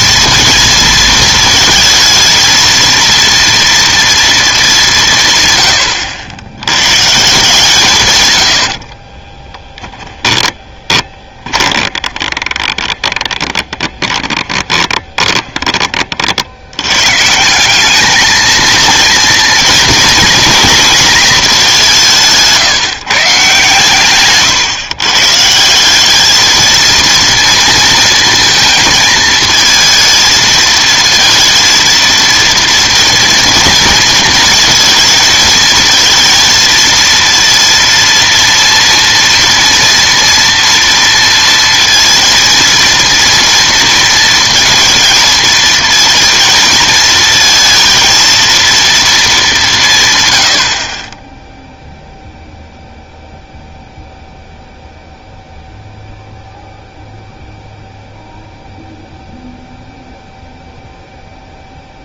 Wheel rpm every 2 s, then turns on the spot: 230, 230, 200, 110, 70, 20, 20, 30, 100, 230, 230, 160, 130, 220, 230, 230, 230, 230, 230, 230, 230, 230, 230, 220, 230, 60, 0, 0, 0, 0, 0.
8-16